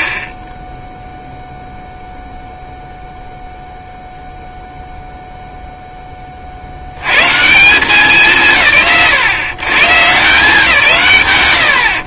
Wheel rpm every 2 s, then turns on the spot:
10, 0, 0, 80, 130, 160.
none